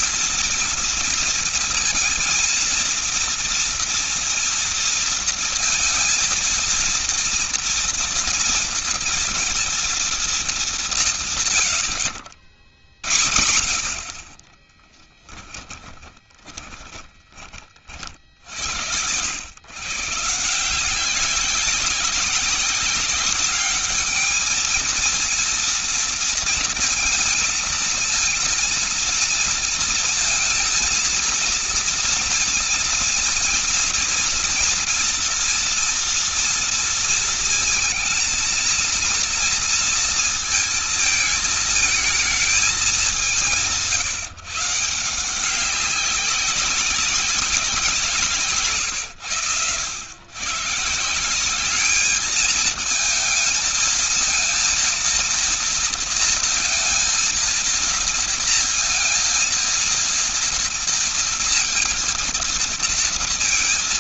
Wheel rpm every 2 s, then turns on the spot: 230, 230, 230, 230, 230, 190, 60, 30, 30, 70, 160, 190, 220, 230, 230, 220, 230, 230, 230, 230, 230, 220, 150, 190, 150, 130, 220, 230, 230, 230, 230, 230.
14-18